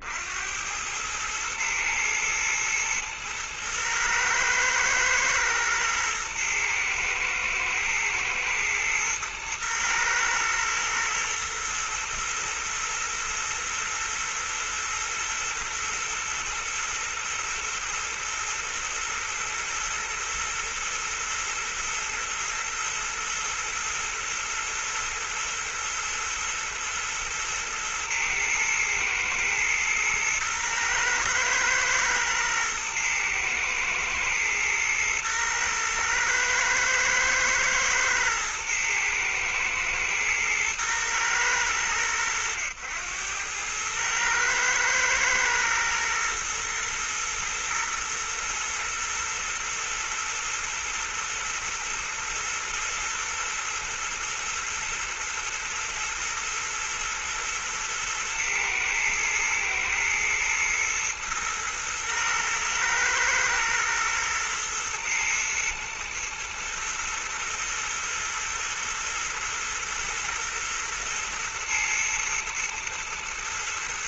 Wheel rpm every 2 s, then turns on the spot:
90, 110, 110, 110, 110, 110, 110, 110, 110, 120, 120, 110, 120, 120, 120, 110, 110, 120, 110, 110, 120, 90, 110, 110, 120, 120, 120, 120, 110, 110, 120, 120, 110, 120, 120, 110, 110.
none